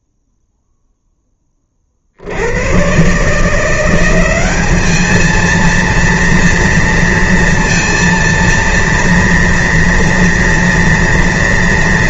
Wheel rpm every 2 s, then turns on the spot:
0, 60, 190, 230, 230, 240.
none